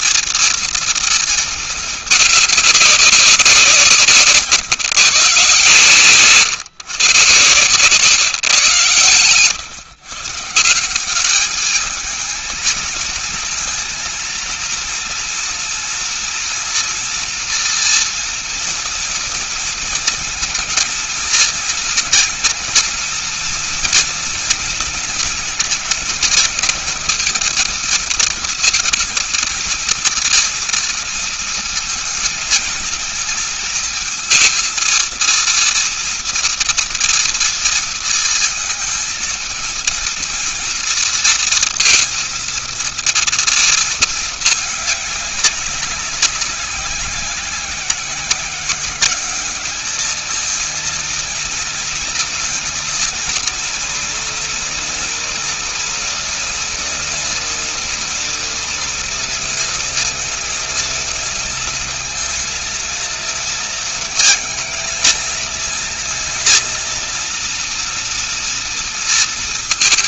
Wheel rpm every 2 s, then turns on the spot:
230, 200, 140, 120, 120, 190, 220, 230, 230, 230, 230, 230, 230, 220, 230, 240, 220, 230, 230, 230, 230, 230, 210, 180, 200, 230, 230, 230, 230, 230, 230, 230, 220, 230, 230.
none